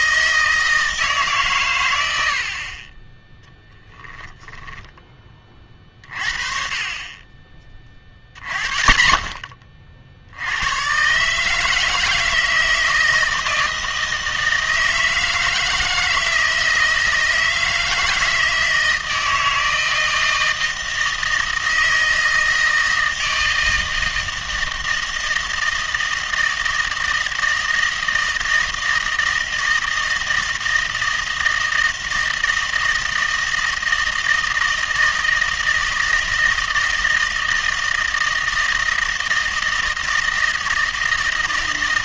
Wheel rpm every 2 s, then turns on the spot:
160, 40, 10, 40, 50, 100, 160, 160, 160, 160, 160, 160, 160, 160, 160, 160, 160, 160, 160, 160, 160.
4-6